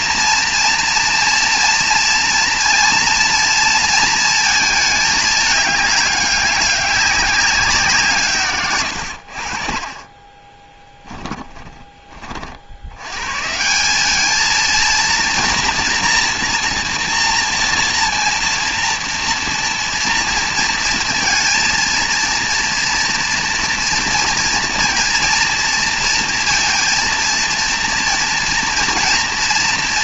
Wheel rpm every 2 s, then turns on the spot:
230, 230, 220, 200, 130, 20, 70, 230, 230, 230, 230, 230, 230, 230, 230.
8-12